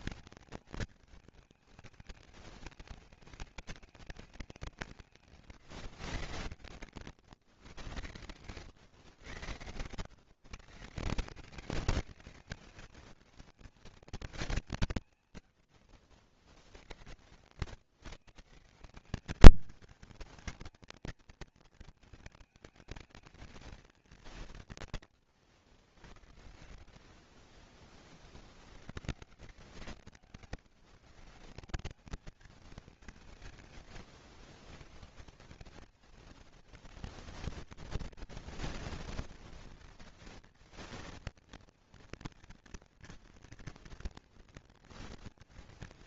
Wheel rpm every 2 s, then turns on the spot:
210, 210, 170, 140, 110, 170, 210, 130, 80, 190, 230, 220, 120, 70, 100, 160, 160, 140, 230, 230, 230, 230, 230.
24-28